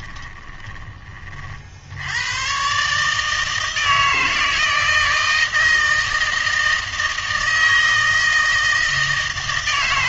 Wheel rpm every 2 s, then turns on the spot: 20, 140, 160, 160, 160.
none